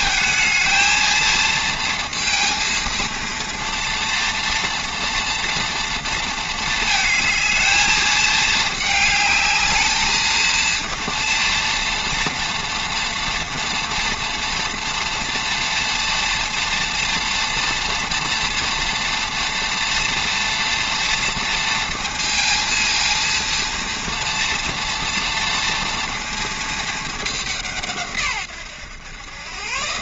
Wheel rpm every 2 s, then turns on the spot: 220, 230, 240, 220, 220, 230, 230, 230, 230, 230, 230, 230, 230, 210, 120.
none